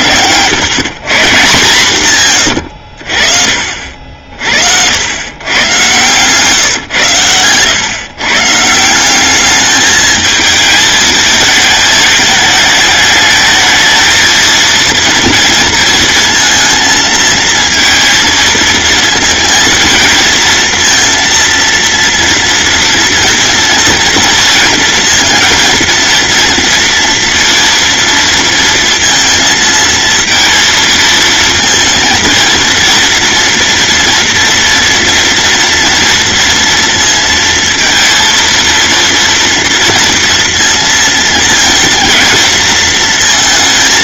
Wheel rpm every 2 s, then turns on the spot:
140, 50, 120, 110, 200, 220, 210, 230, 230, 230, 230, 230, 230, 230, 230, 230, 240, 230, 230, 230, 230, 230.
none